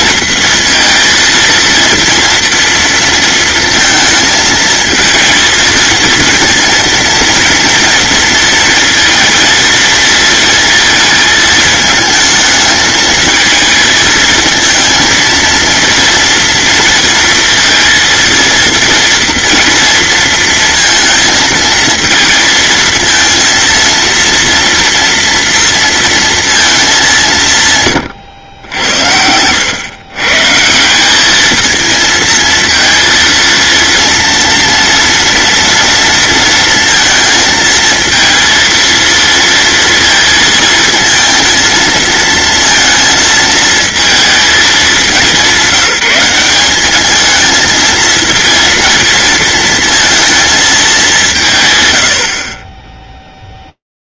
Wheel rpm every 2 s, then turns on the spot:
230, 230, 220, 230, 230, 230, 220, 230, 230, 230, 230, 230, 230, 220, 90, 160, 230, 230, 230, 230, 230, 230, 210, 200, 230, 220, 40.
28-30